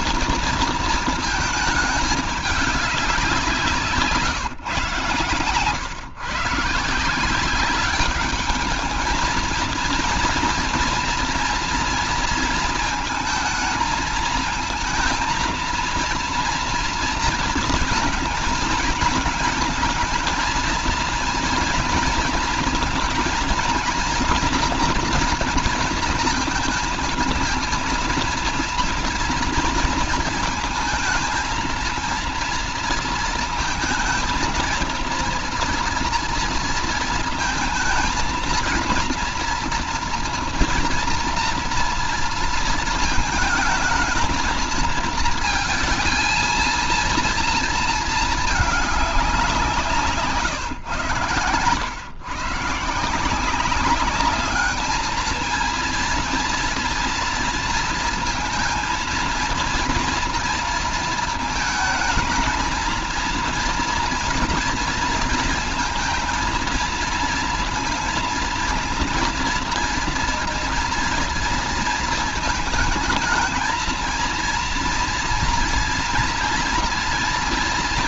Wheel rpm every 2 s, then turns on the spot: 230, 200, 130, 170, 220, 230, 230, 230, 230, 220, 230, 230, 230, 230, 230, 220, 230, 230, 230, 230, 240, 220, 230, 230, 200, 110, 180, 220, 230, 230, 230, 230, 230, 230, 230, 230, 220, 230, 230.
4-6